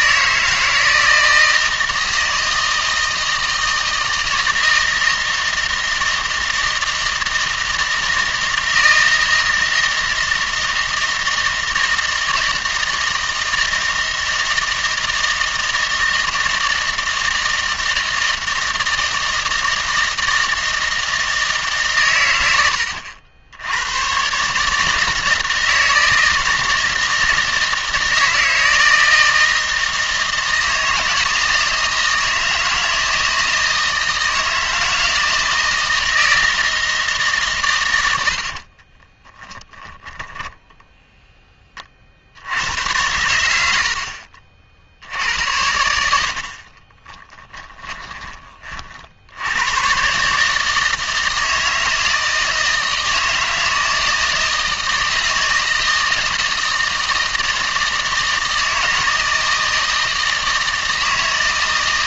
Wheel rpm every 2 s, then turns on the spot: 160, 160, 160, 160, 160, 160, 160, 160, 160, 160, 160, 90, 150, 160, 160, 160, 160, 160, 160, 50, 10, 100, 60, 40, 40, 150, 160, 160, 170, 160, 160.
38-40 46-48